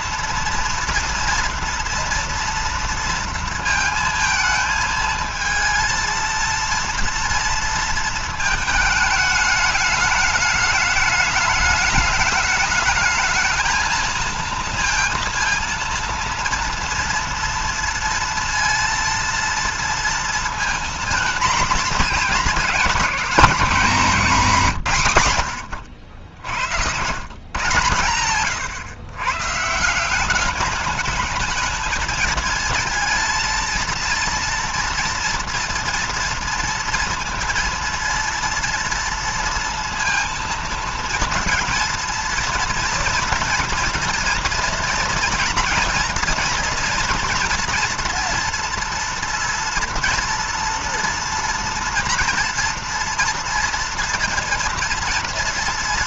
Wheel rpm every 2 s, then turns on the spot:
230, 230, 220, 230, 220, 210, 210, 230, 230, 230, 230, 240, 210, 90, 130, 200, 220, 230, 230, 230, 230, 230, 230, 240, 240, 240, 230, 230.
none